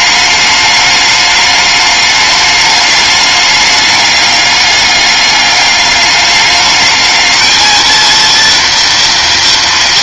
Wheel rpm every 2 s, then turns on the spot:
210, 210, 200, 210, 230.
none